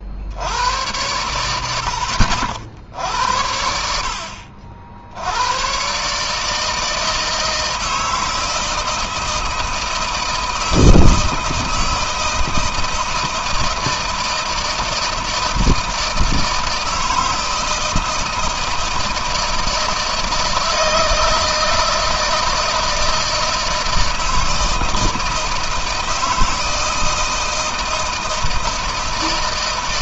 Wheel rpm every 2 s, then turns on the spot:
100, 80, 70, 160, 160, 160, 160, 160, 160, 160, 160, 160, 160, 160, 160.
none